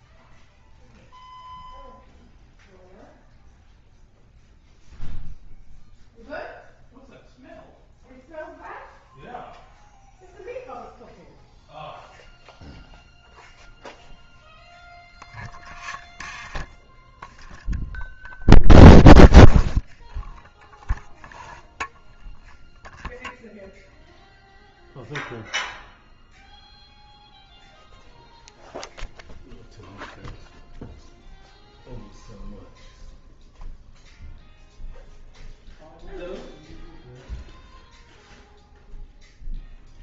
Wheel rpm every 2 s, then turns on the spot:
0, 0, 0, 0, 0, 0, 0, 0, 0, 0, 0, 0, 0, 0, 0, 0, 0, 0, 0, 0.
none